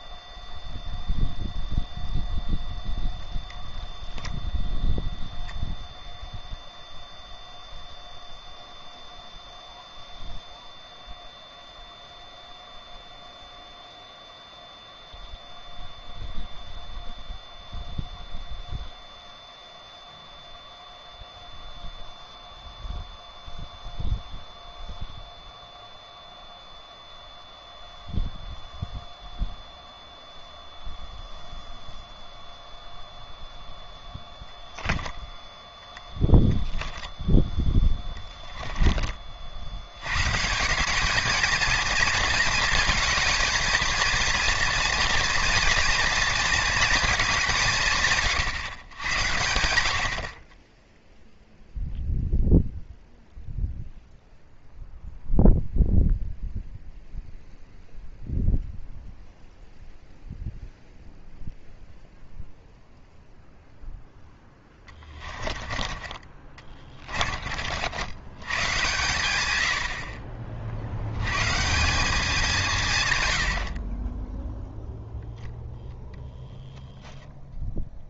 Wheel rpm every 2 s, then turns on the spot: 0, 0, 0, 0, 0, 0, 0, 0, 0, 0, 0, 0, 0, 0, 0, 0, 0, 10, 0, 20, 190, 230, 230, 220, 120, 10, 0, 0, 0, 0, 0, 0, 10, 30, 120, 70, 150, 0, 10.
64-68